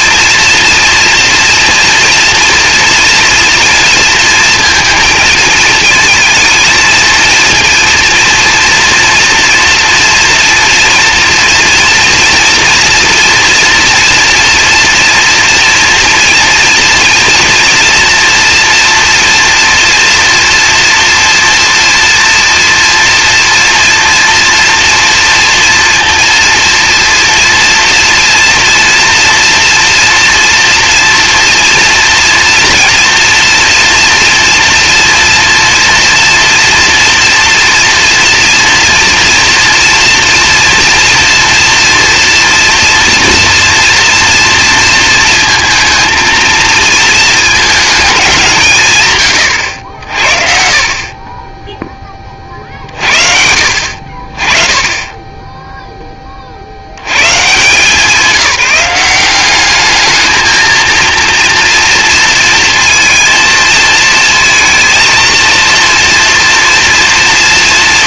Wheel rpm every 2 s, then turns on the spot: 230, 230, 230, 220, 230, 230, 230, 230, 240, 230, 230, 230, 230, 240, 240, 230, 240, 240, 240, 240, 230, 230, 230, 230, 150, 40, 50, 20, 30, 170, 220, 230, 230, 240.
none